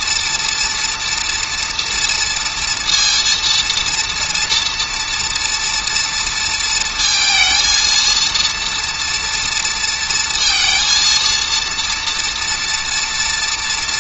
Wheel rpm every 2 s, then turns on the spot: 240, 230, 230, 220, 230, 230, 230.
none